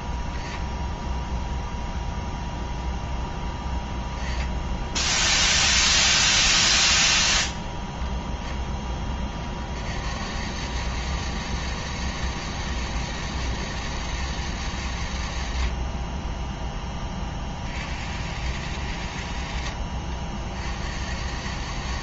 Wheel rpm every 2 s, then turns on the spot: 0, 0, 10, 10, 20, 100, 110, 110, 10, 90, 60.
none